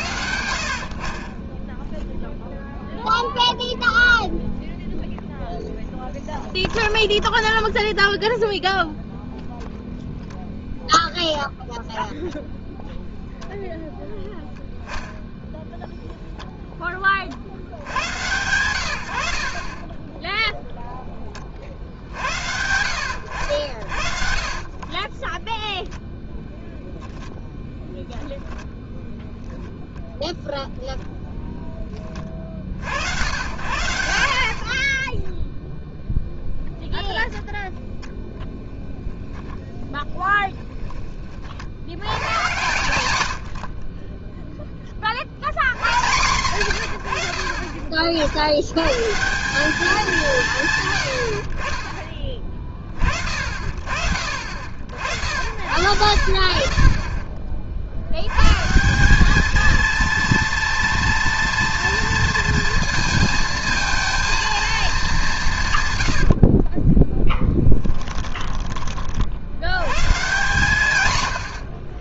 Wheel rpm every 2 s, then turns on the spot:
70, 0, 0, 10, 0, 0, 0, 0, 10, 100, 0, 80, 40, 0, 10, 0, 50, 60, 0, 0, 10, 120, 10, 120, 100, 150, 30, 70, 40, 150, 230, 230, 230, 50, 20, 140.
6-8 34-36 66-68